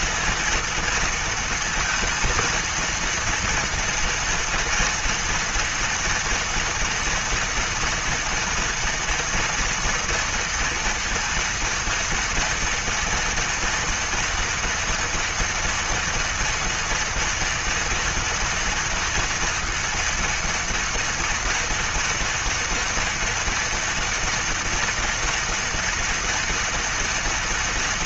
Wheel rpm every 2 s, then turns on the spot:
230, 230, 230, 230, 230, 230, 230, 240, 230, 230, 230, 240, 230, 230.
none